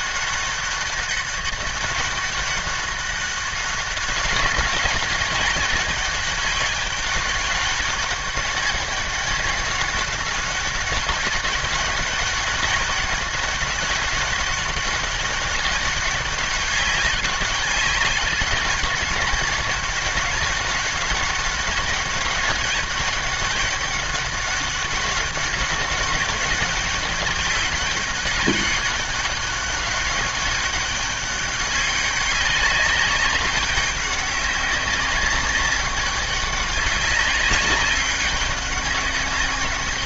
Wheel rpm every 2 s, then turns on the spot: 200, 200, 190, 200, 190, 190, 200, 190, 200, 200, 200, 200, 200, 200, 200, 200, 200, 200, 200, 200.
none